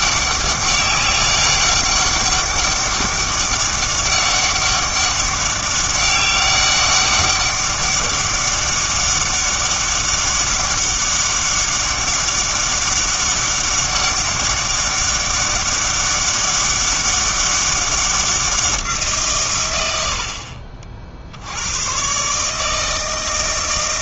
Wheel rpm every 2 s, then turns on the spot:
200, 200, 200, 200, 200, 200, 200, 200, 200, 170, 50, 160.
none